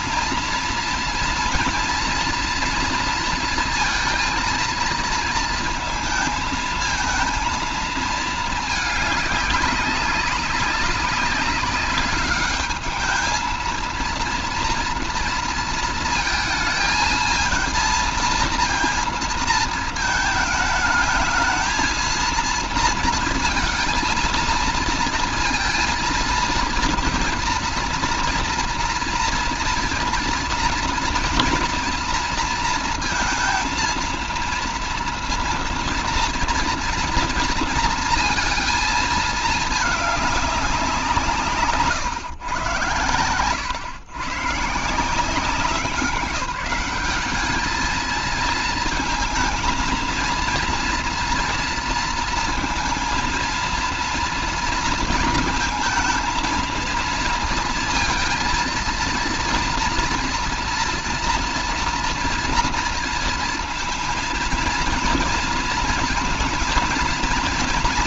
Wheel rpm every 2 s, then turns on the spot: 230, 230, 230, 220, 220, 200, 200, 230, 220, 230, 220, 230, 230, 230, 230, 230, 230, 230, 230, 230, 200, 120, 130, 190, 220, 230, 230, 230, 230, 230, 230, 230, 230, 230.
none